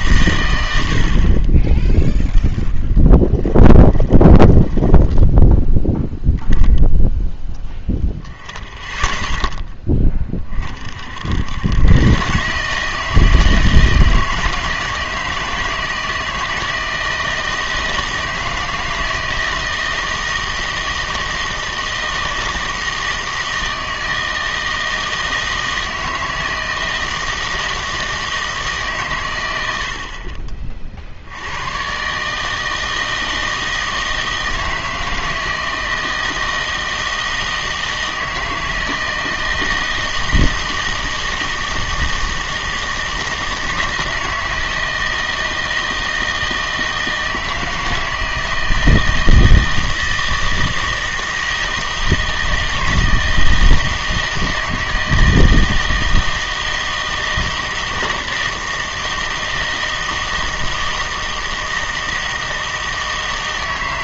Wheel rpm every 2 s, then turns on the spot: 90, 10, 10, 10, 0, 50, 150, 160, 160, 160, 160, 160, 160, 160, 150, 40, 160, 160, 160, 160, 160, 160, 160, 160, 160, 160, 160, 160, 160, 160, 160, 160.
2-6